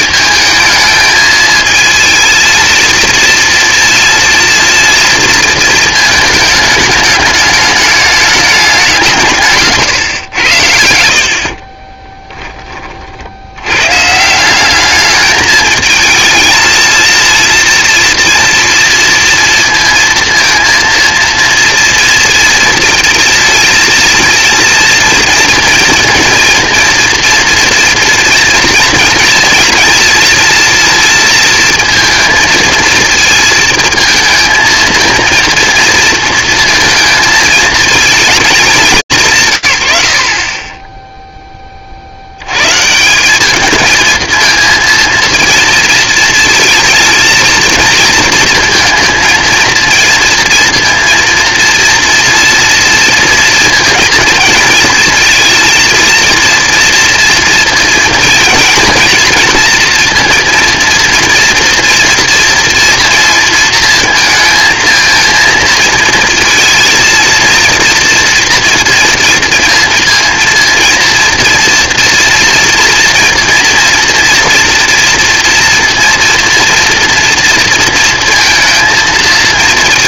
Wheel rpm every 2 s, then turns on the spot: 220, 230, 230, 210, 200, 90, 30, 190, 220, 230, 230, 230, 230, 230, 240, 230, 220, 230, 230, 190, 30, 110, 230, 230, 220, 230, 230, 220, 230, 230, 230, 230, 230, 230, 230, 230, 230, 240, 230, 230.
none